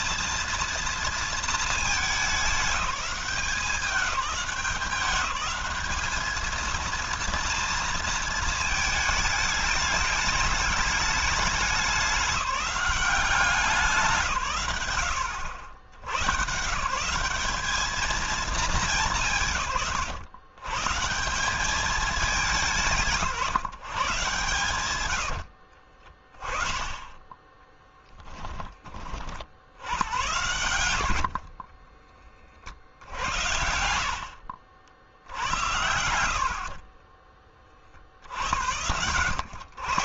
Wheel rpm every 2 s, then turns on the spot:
230, 190, 200, 230, 220, 210, 190, 120, 160, 200, 140, 170, 110, 10, 20, 90, 50, 60, 40, 90.
24-26 36-38